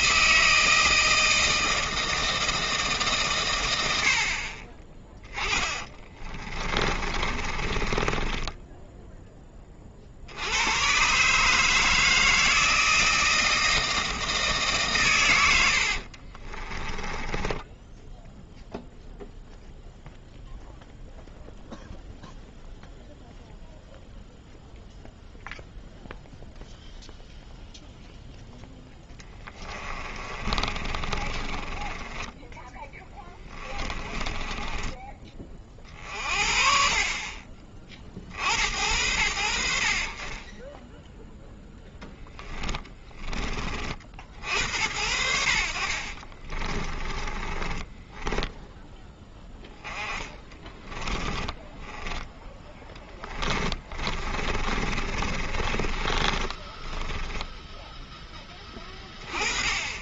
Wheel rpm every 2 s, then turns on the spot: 160, 150, 30, 40, 10, 120, 160, 140, 20, 0, 0, 0, 0, 0, 10, 30, 10, 20, 40, 80, 0, 10, 80, 20, 10, 20, 10, 50, 30, 20.
6-10 16-18 28-36 42-44 46-48 50-58